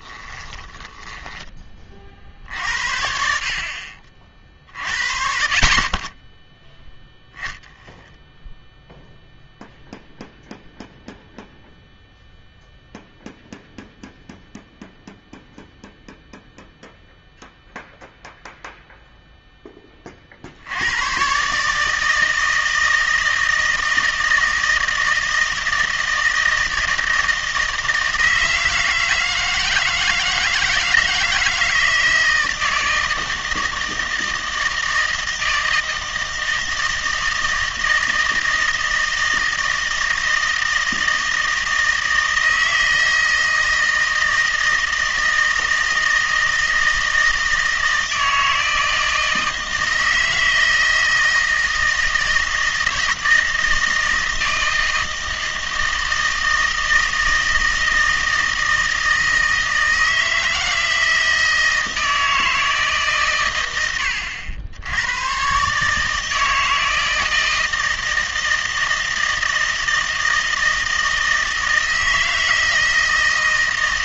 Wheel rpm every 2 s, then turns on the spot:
20, 60, 50, 10, 0, 0, 0, 0, 0, 0, 80, 160, 160, 160, 160, 160, 160, 160, 160, 160, 160, 160, 160, 160, 160, 160, 160, 160, 160, 170, 160, 160, 80, 160, 160, 160, 160.
0-2